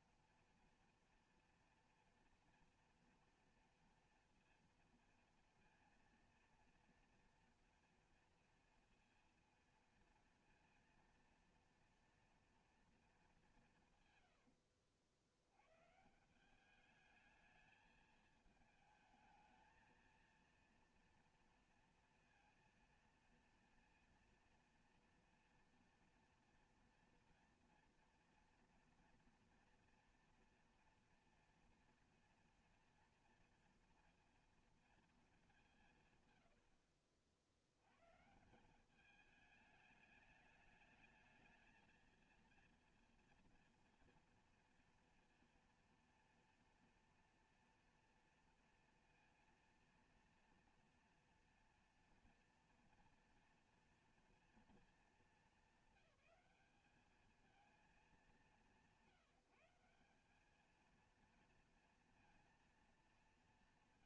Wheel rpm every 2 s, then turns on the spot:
230, 230, 230, 230, 230, 230, 230, 80, 180, 220, 230, 230, 230, 230, 230, 230, 230, 230, 90, 160, 210, 230, 230, 230, 230, 240, 240, 230, 200, 180, 210, 230.
14-16